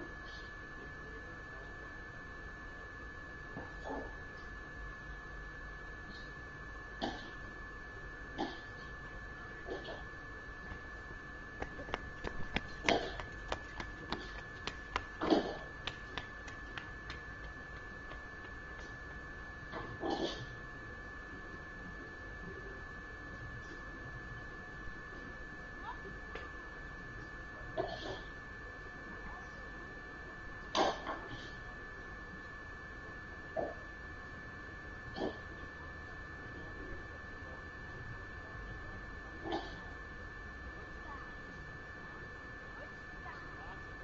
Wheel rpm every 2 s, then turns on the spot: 0, 0, 0, 0, 0, 0, 0, 0, 0, 0, 0, 0, 0, 0, 0, 0, 0, 0, 0, 0, 0, 0.
none